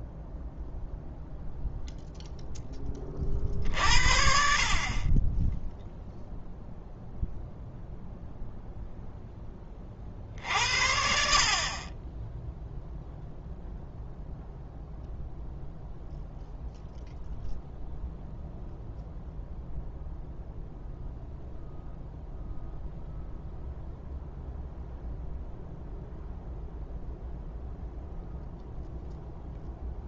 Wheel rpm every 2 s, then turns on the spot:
0, 10, 50, 0, 0, 60, 0, 0, 0, 0, 0, 0, 0, 0, 0.
none